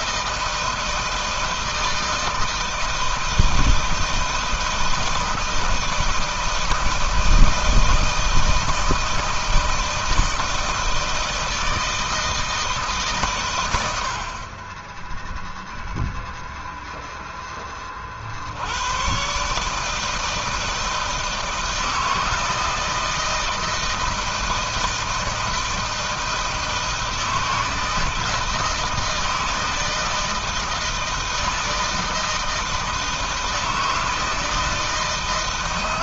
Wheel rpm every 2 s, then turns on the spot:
160, 160, 160, 160, 160, 160, 160, 40, 0, 80, 160, 160, 160, 160, 160, 160, 160, 160.
none